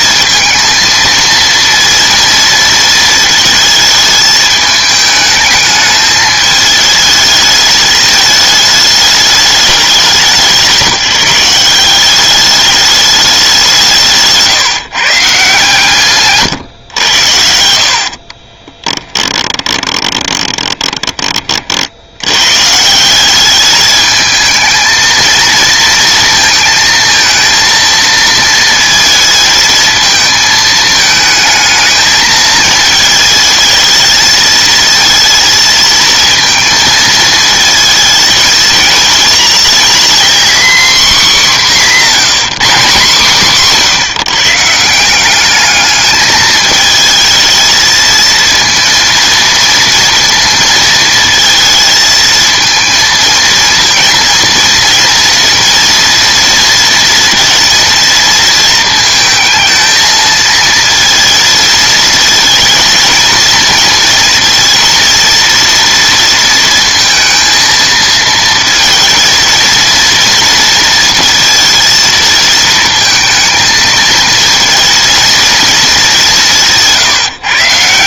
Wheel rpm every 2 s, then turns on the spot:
230, 230, 210, 220, 210, 170, 210, 160, 110, 20, 20, 150, 220, 220, 230, 220, 220, 220, 230, 230, 260, 190, 160, 220, 230, 230, 220, 230, 230, 220, 230, 220, 230, 230, 220, 230, 220, 220, 190.
18-22